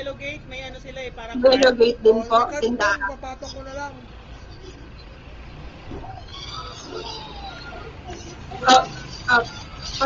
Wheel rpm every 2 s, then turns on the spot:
0, 0, 0, 0, 0.
none